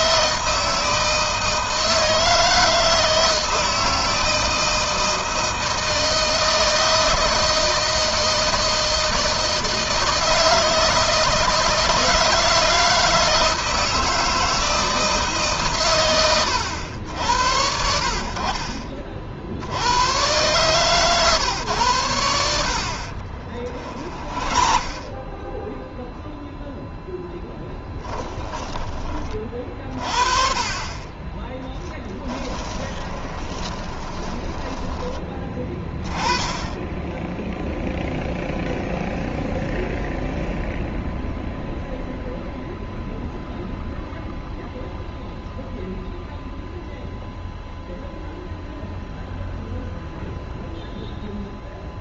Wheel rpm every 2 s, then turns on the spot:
160, 160, 160, 160, 160, 160, 160, 160, 100, 50, 130, 80, 30, 0, 20, 40, 20, 10, 10, 0, 0, 0, 0, 0, 0, 0.
22-26 32-36